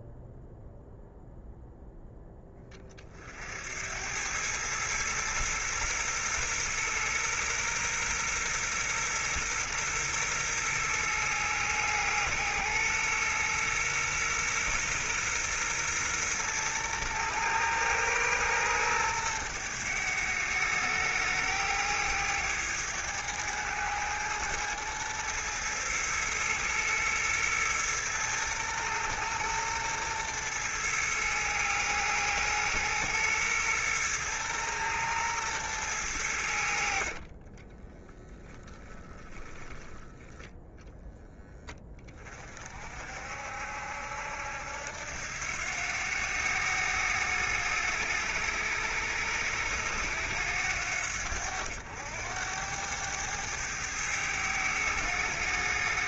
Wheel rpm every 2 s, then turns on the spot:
0, 30, 110, 120, 120, 120, 120, 120, 120, 110, 110, 110, 110, 110, 110, 110, 120, 110, 50, 20, 10, 50, 80, 100, 100, 90, 100, 100.
36-40